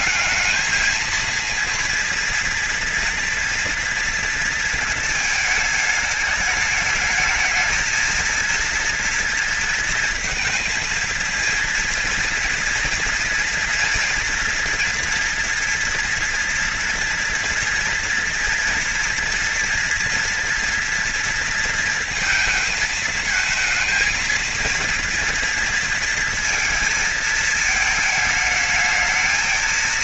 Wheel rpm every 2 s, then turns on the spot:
220, 230, 230, 210, 230, 230, 240, 230, 230, 230, 230, 220, 230, 220, 220.
none